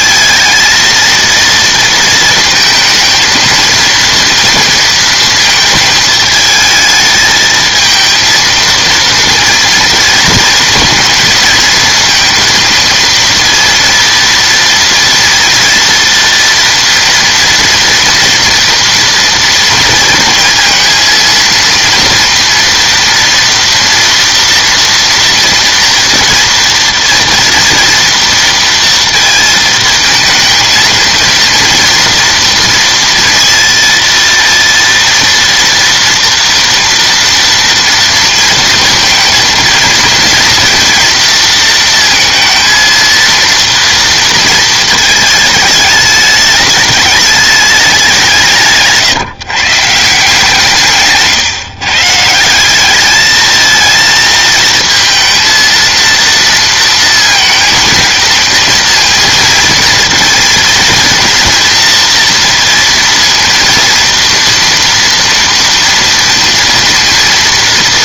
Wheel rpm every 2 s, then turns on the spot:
230, 220, 230, 220, 230, 230, 230, 230, 230, 230, 230, 230, 230, 230, 230, 230, 230, 230, 230, 230, 230, 220, 230, 210, 160, 150, 180, 220, 230, 230, 230, 230, 230, 230.
none